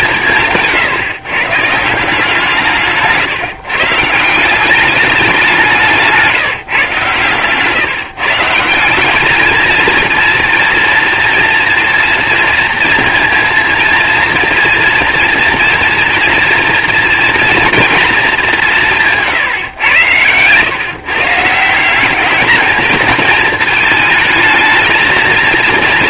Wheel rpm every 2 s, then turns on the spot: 140, 150, 190, 130, 200, 230, 230, 230, 240, 150, 150, 220, 220.
none